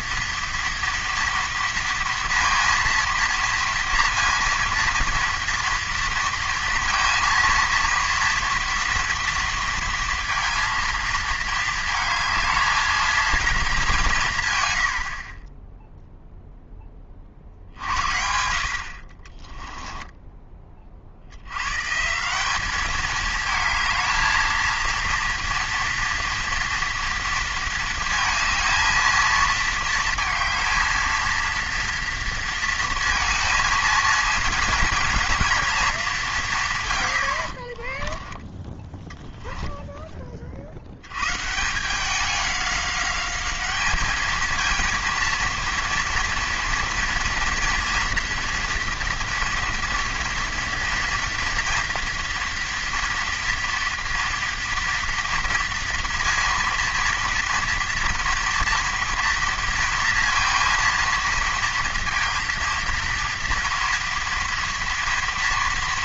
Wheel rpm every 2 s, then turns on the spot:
230, 230, 230, 230, 230, 230, 220, 110, 10, 50, 30, 200, 230, 230, 220, 220, 230, 230, 150, 10, 60, 200, 220, 230, 230, 230, 230, 230, 230, 230, 230, 230, 230.
none